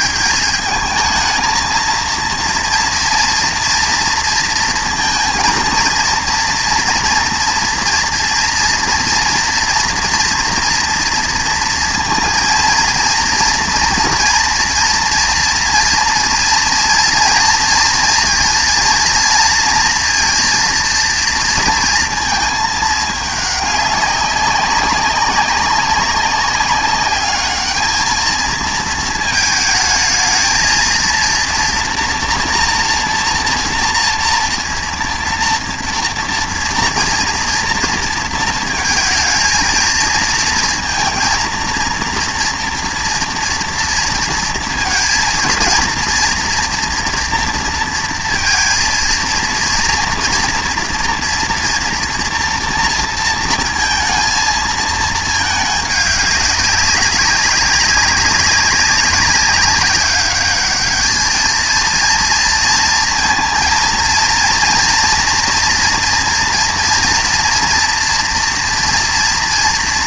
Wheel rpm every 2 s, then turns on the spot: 220, 230, 230, 230, 230, 230, 230, 230, 230, 230, 230, 210, 200, 200, 220, 230, 230, 230, 230, 220, 230, 230, 230, 240, 230, 230, 230, 220, 190, 190, 210, 230, 230, 240, 230.
none